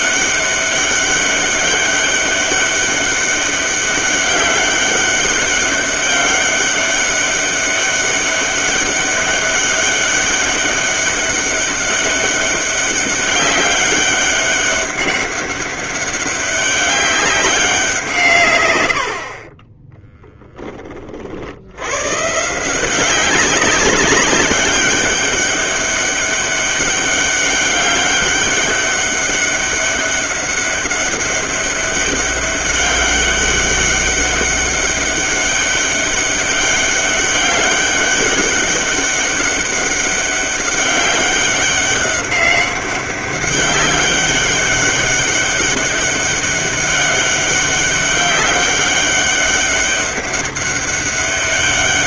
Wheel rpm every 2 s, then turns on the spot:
200, 200, 190, 200, 200, 200, 200, 200, 200, 100, 20, 180, 200, 200, 200, 200, 200, 200, 200, 200, 200, 200, 200, 190, 200, 200.
none